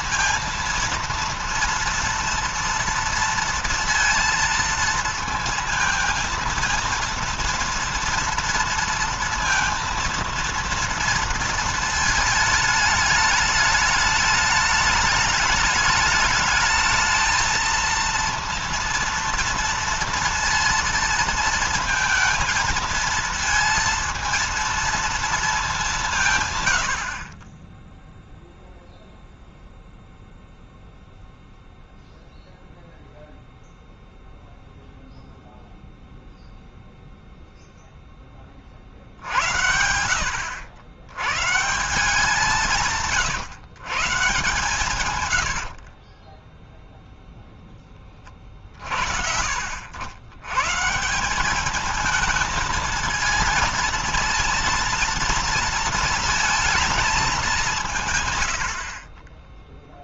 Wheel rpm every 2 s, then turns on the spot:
230, 230, 230, 230, 230, 230, 220, 210, 210, 230, 230, 220, 230, 150, 0, 0, 0, 0, 0, 50, 100, 170, 140, 10, 40, 120, 220, 230, 220, 80.
none